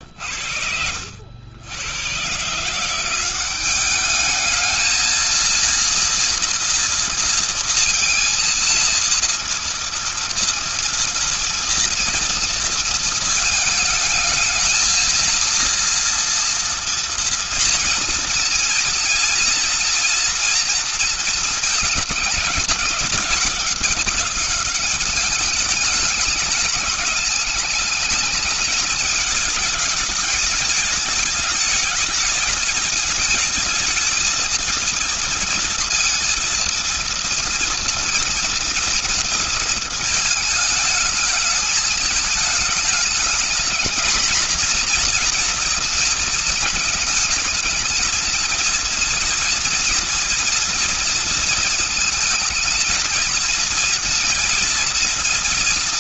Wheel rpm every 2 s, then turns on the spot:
70, 170, 220, 230, 230, 230, 230, 220, 230, 230, 230, 210, 200, 210, 220, 220, 220, 230, 230, 230, 210, 210, 240, 220, 230, 230, 220, 230.
none